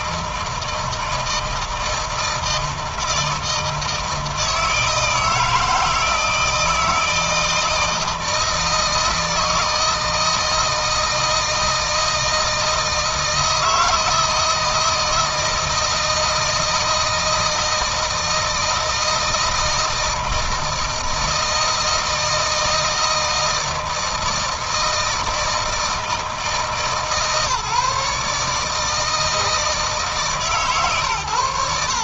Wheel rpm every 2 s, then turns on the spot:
160, 160, 160, 160, 160, 160, 160, 160, 160, 160, 160, 160, 160, 160, 160, 130.
none